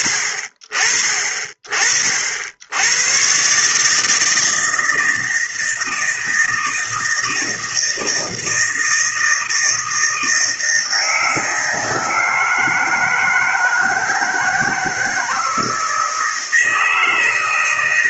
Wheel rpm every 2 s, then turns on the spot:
40, 90, 160, 160, 160, 160, 160, 160, 160.
none